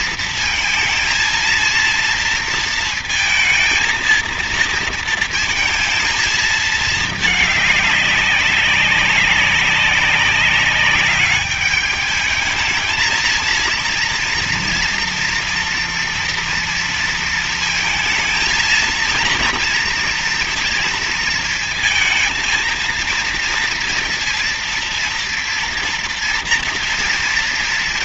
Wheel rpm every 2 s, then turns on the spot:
230, 230, 230, 220, 200, 190, 220, 230, 230, 220, 230, 230, 230, 230.
none